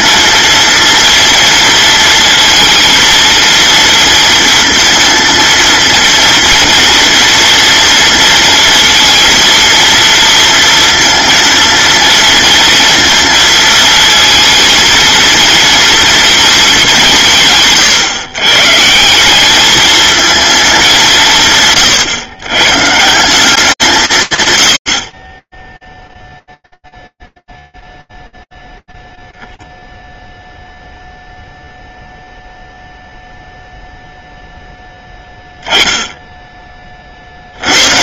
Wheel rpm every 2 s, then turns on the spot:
230, 230, 230, 240, 230, 230, 230, 230, 210, 130, 200, 140, 80, 0, 0, 0, 0, 10, 50.
none